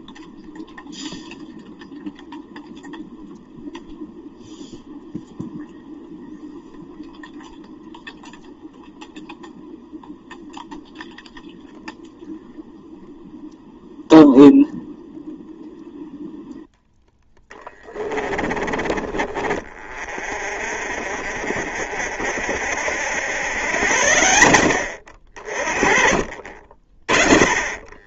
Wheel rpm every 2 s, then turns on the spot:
0, 0, 0, 0, 0, 0, 0, 0, 0, 20, 0, 0, 30, 30.
18-20 26-28